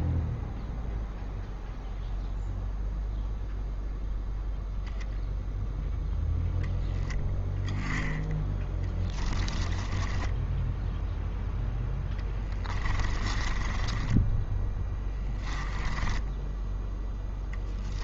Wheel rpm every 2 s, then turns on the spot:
0, 0, 0, 10, 10, 10, 20, 10, 10.
8-16